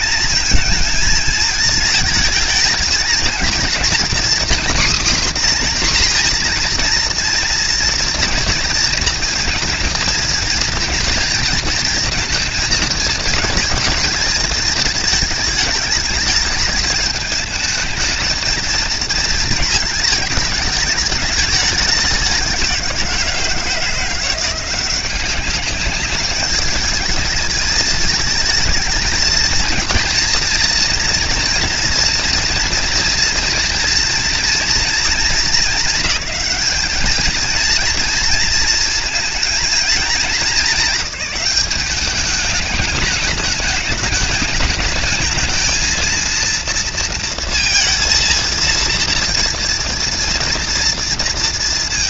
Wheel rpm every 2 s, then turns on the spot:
230, 220, 250, 240, 230, 230, 220, 210, 210, 230, 220, 190, 180, 210, 220, 230, 240, 230, 210, 220, 220, 210, 210, 230, 230, 230.
none